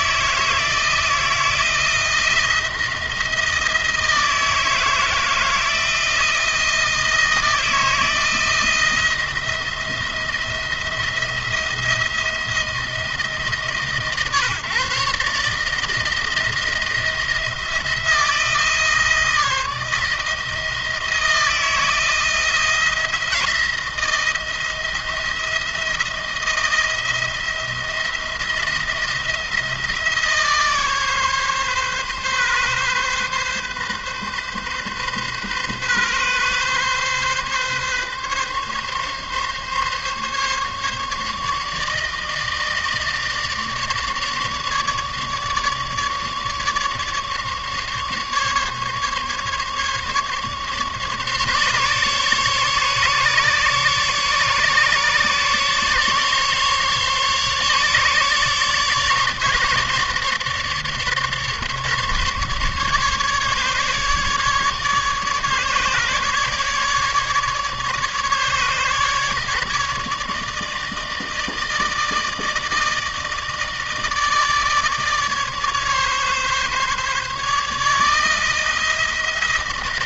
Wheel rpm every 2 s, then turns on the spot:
160, 170, 160, 160, 160, 170, 160, 140, 170, 160, 160, 170, 170, 170, 170, 150, 130, 130, 140, 140, 140, 160, 150, 150, 140, 140, 140, 140, 140, 150, 150, 140, 150, 150, 150, 160, 160, 150, 150, 160.
none